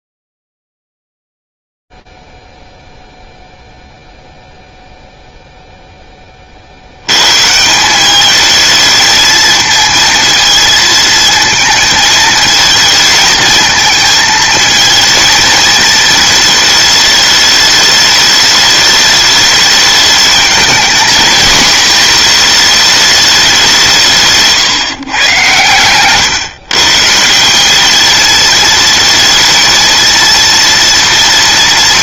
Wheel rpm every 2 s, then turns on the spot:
0, 0, 0, 0, 170, 220, 220, 220, 220, 210, 210, 220, 180, 120, 200, 230.
none